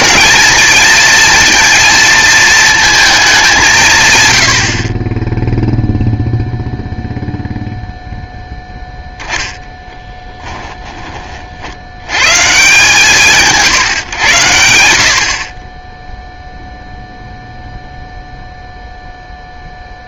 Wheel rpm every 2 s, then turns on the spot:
230, 220, 60, 0, 10, 10, 160, 80, 0, 0.
none